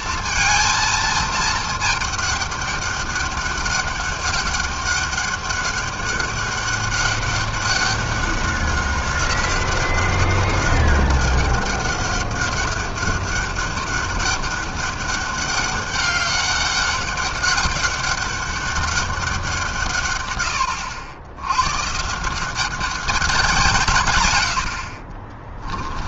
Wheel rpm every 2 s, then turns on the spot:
230, 210, 200, 200, 200, 200, 200, 200, 200, 200, 100, 180, 90.
none